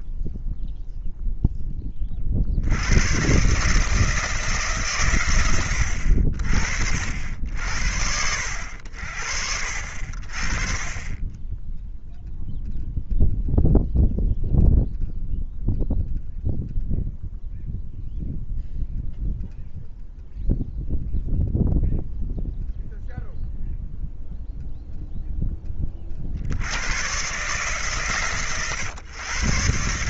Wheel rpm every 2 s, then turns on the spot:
0, 70, 160, 70, 70, 30, 0, 0, 0, 0, 0, 0, 0, 80, 120.
none